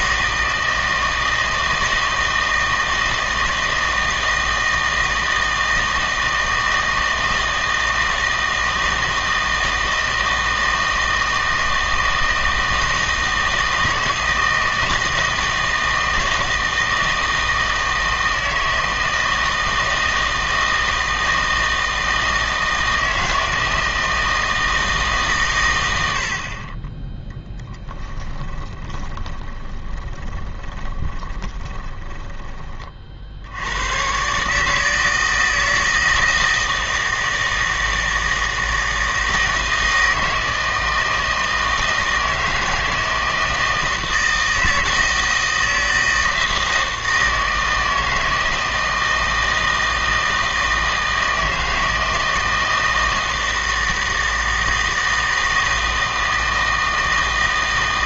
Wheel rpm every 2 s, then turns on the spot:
160, 160, 160, 160, 160, 160, 160, 160, 160, 160, 160, 160, 160, 40, 10, 20, 30, 150, 160, 160, 160, 160, 160, 160, 160, 160, 160, 160, 160.
28-32